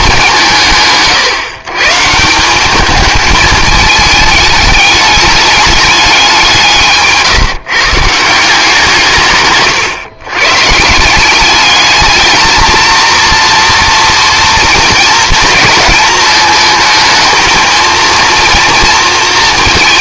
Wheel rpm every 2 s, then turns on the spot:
140, 200, 210, 160, 170, 140, 230, 230, 220, 230.
none